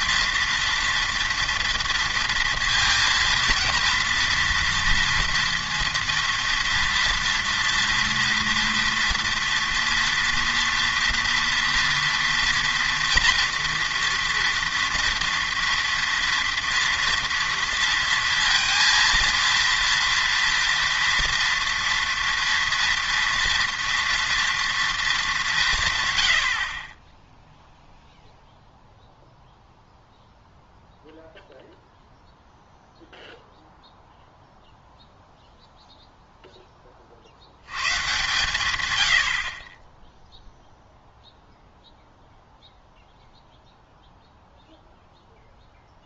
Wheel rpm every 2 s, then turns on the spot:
230, 230, 230, 230, 230, 230, 230, 230, 230, 230, 230, 230, 230, 50, 0, 0, 0, 0, 10, 100, 0, 0, 0.
none